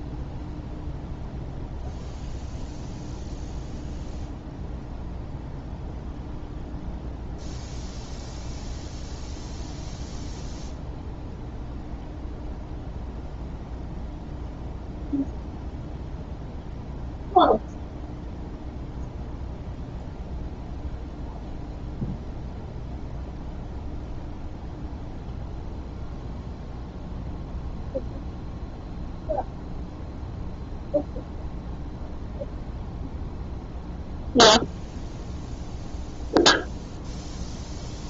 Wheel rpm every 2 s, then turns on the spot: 0, 0, 0, 0, 0, 0, 0, 0, 0, 0, 0, 0, 0, 0, 0, 0, 0, 0, 0.
none